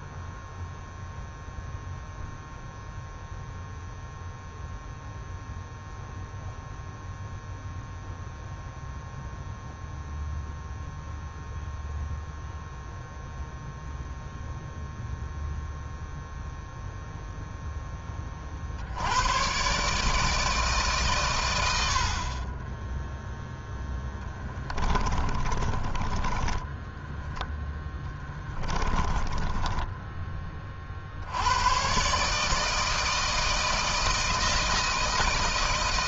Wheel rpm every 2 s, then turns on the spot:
0, 0, 0, 0, 0, 0, 0, 0, 0, 40, 150, 20, 20, 20, 20, 30, 150, 170.
24-30